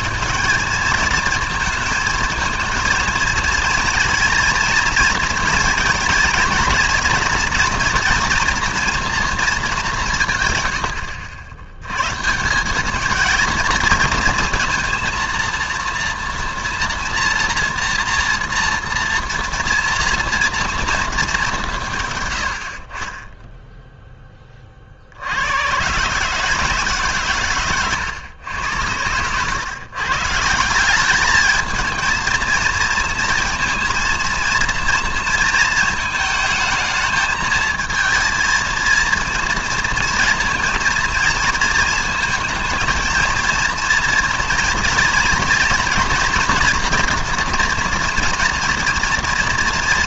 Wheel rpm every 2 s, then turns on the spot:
210, 220, 230, 230, 230, 110, 180, 230, 240, 230, 230, 80, 30, 160, 100, 170, 230, 230, 220, 230, 230, 220, 230, 240, 240.
22-24